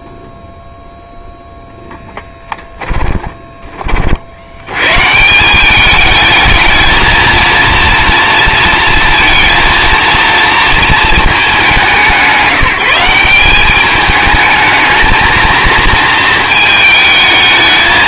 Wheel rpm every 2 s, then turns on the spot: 0, 10, 90, 220, 230, 230, 180, 220, 220.
2-4